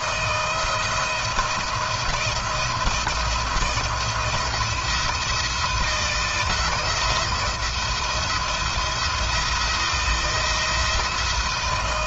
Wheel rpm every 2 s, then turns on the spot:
160, 170, 170, 170, 170, 160.
none